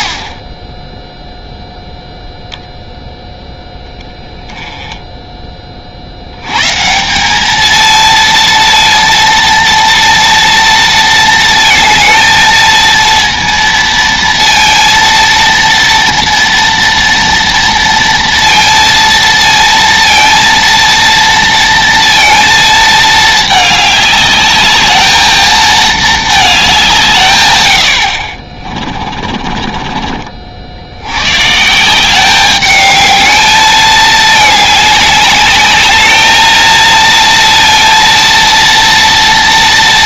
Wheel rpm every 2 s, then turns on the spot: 20, 0, 10, 140, 230, 230, 230, 230, 230, 230, 230, 220, 210, 180, 40, 80, 210, 210, 220, 230.
28-30